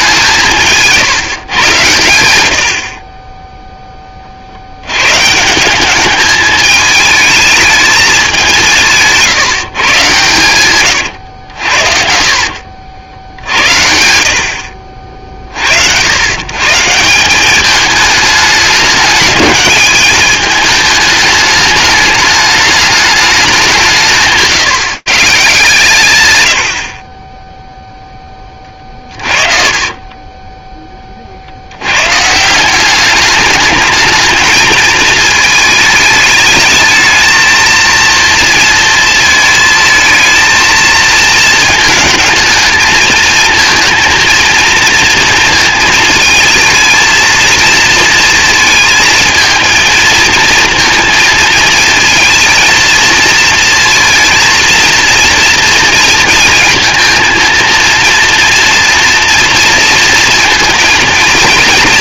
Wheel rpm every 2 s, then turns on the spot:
160, 60, 70, 210, 170, 120, 60, 50, 150, 200, 220, 210, 180, 120, 30, 20, 180, 220, 220, 230, 220, 220, 230, 220, 230, 230, 220, 230, 230, 230, 230.
10-12 28-30